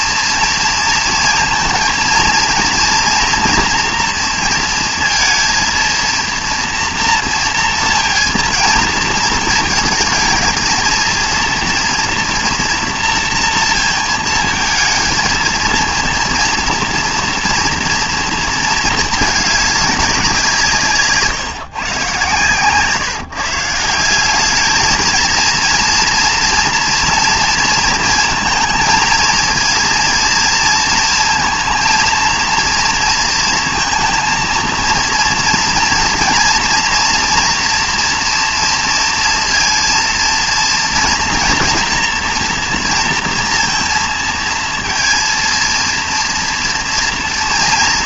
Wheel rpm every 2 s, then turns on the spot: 230, 230, 230, 230, 230, 220, 230, 230, 230, 220, 170, 130, 210, 230, 230, 230, 230, 230, 230, 230, 230, 230, 230, 230.
none